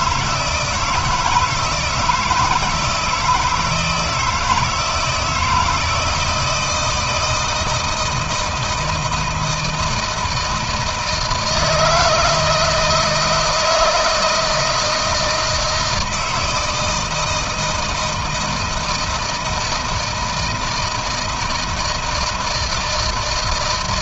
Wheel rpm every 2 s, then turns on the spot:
160, 170, 160, 160, 160, 160, 160, 160, 170, 160, 160, 160.
none